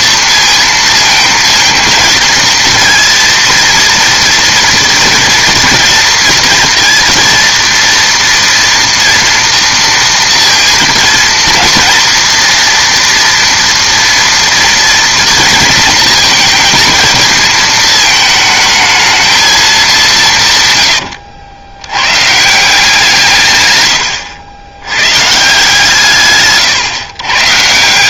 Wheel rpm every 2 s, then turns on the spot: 230, 230, 230, 230, 240, 230, 230, 230, 230, 220, 130, 160, 90, 140.
20-22